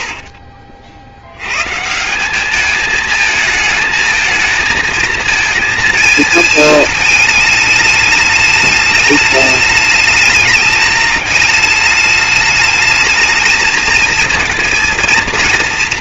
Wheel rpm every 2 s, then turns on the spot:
40, 210, 230, 220, 210, 210, 210, 230.
none